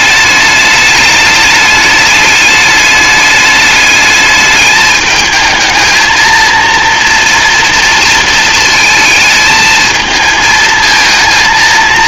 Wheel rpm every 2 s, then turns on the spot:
210, 210, 210, 230, 220, 220.
none